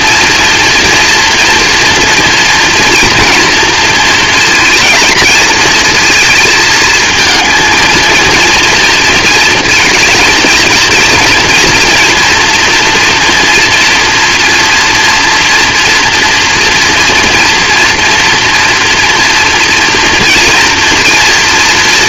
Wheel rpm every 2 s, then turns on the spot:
230, 230, 230, 220, 230, 230, 230, 240, 230, 230, 230.
none